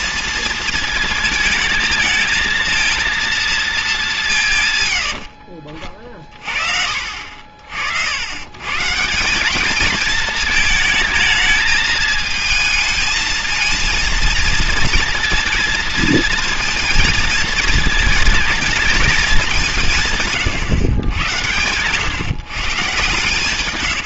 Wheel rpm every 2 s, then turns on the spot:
220, 230, 120, 50, 140, 220, 220, 230, 230, 230, 120, 130.
4-6